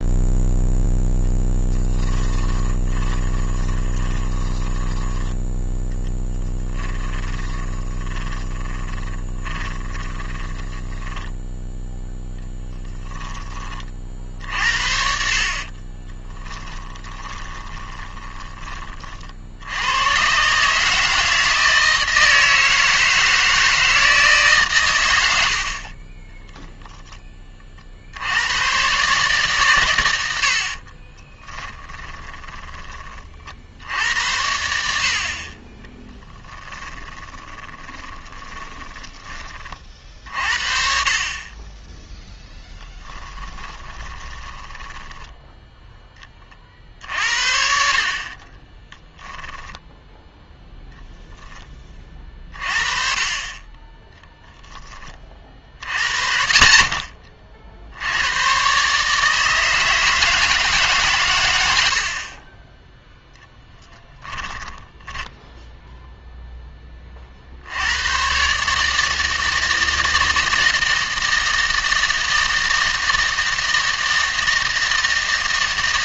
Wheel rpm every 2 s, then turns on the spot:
0, 20, 10, 10, 10, 10, 0, 60, 10, 30, 150, 160, 130, 0, 110, 50, 30, 70, 20, 20, 50, 10, 10, 40, 20, 0, 30, 20, 80, 130, 160, 10, 10, 10, 150, 160, 160, 160.
2-12 16-18 30-34 36-40 42-46 48-50 64-66